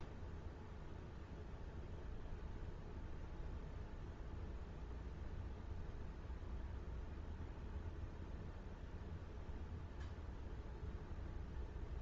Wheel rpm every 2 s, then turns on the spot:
0, 0, 0, 0, 0, 0.
none